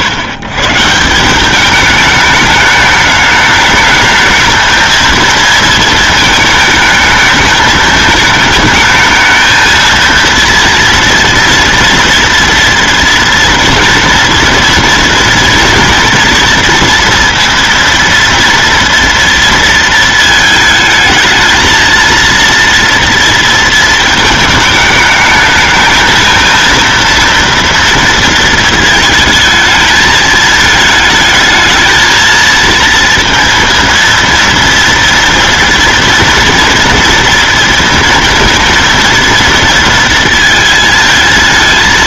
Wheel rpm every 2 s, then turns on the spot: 130, 210, 220, 220, 220, 230, 230, 230, 230, 230, 220, 230, 220, 220, 220, 220, 230, 230, 230, 230, 220.
none